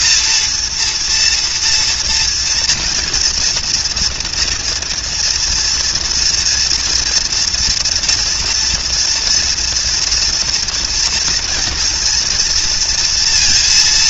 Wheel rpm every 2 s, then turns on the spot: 230, 230, 230, 230, 230, 240, 230.
none